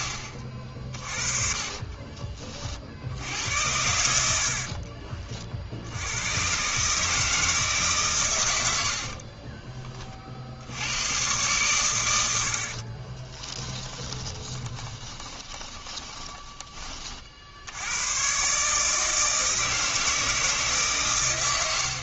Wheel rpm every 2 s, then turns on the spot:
50, 40, 50, 130, 80, 70, 60, 20, 20, 150, 150.
4-6 14-16